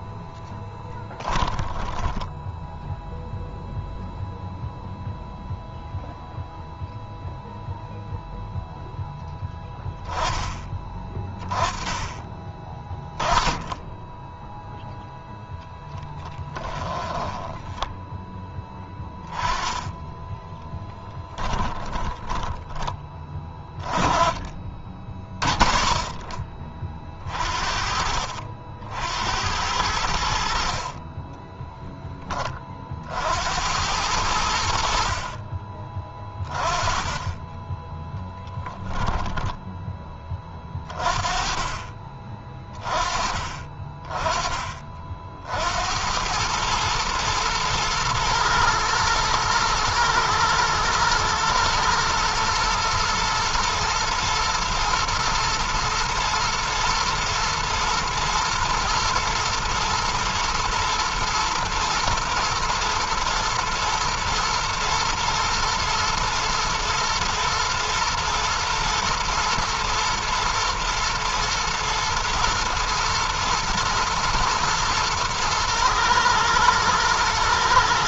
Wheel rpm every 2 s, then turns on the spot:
10, 0, 0, 0, 10, 20, 20, 0, 20, 10, 10, 20, 40, 40, 70, 30, 50, 60, 20, 10, 30, 30, 40, 110, 110, 110, 110, 120, 120, 110, 120, 120, 120, 110, 110, 110, 120, 120, 110.
0-2 16-18 20-22 38-40